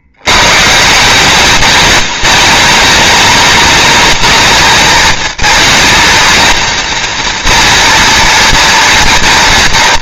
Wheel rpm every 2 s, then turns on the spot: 100, 210, 220, 230, 230.
none